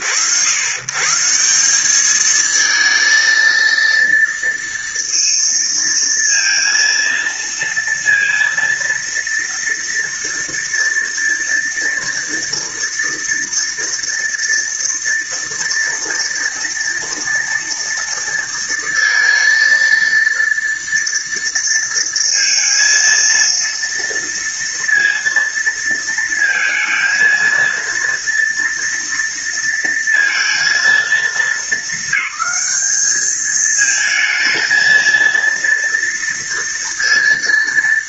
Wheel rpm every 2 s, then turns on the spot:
110, 220, 230, 230, 230, 230, 230, 230, 230, 230, 230, 230, 230, 230, 230, 230, 210, 220, 230.
none